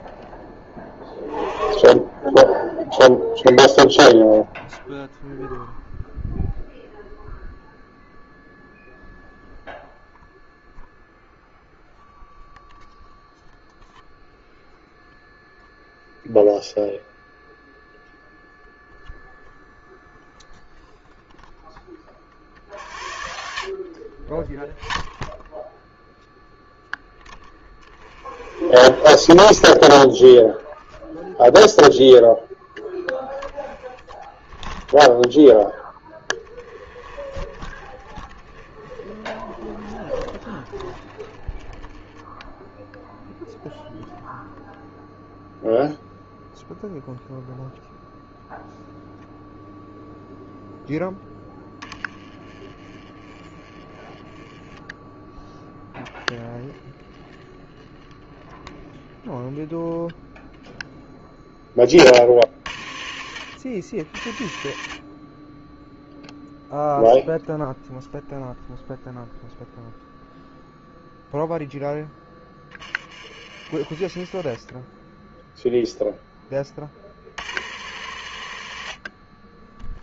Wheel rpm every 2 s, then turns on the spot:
10, 0, 0, 0, 0, 0, 0, 0, 0, 0, 0, 60, 10, 10, 40, 0, 0, 10, 10, 20, 30, 0, 0, 0, 0, 0, 20, 10, 30, 30, 0, 60, 50, 0, 0, 0, 20, 10, 20, 70.
62-66 76-80